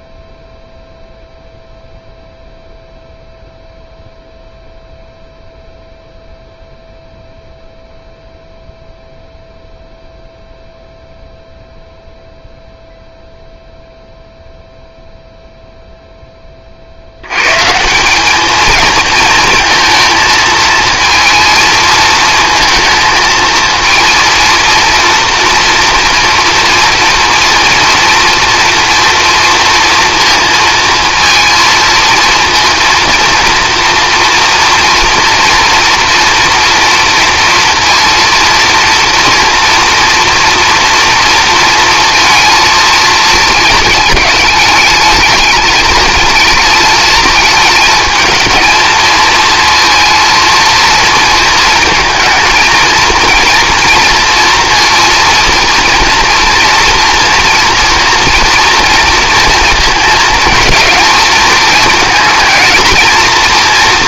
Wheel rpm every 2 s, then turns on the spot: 0, 0, 0, 0, 0, 0, 0, 0, 40, 220, 220, 220, 230, 230, 230, 230, 220, 230, 240, 230, 230, 230, 210, 220, 220, 230, 230, 230, 230, 230, 230, 220.
none